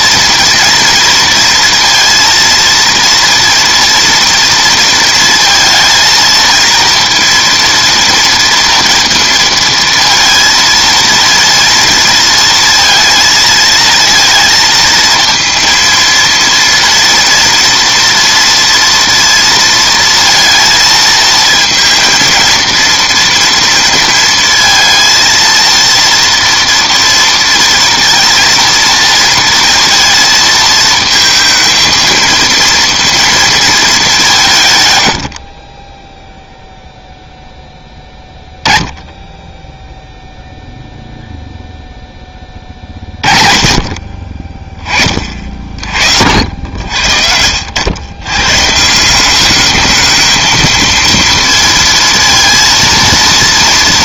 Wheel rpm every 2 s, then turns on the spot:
230, 230, 230, 230, 230, 230, 230, 230, 230, 240, 230, 230, 230, 230, 230, 230, 230, 130, 0, 10, 0, 20, 30, 60, 130, 220, 230.
none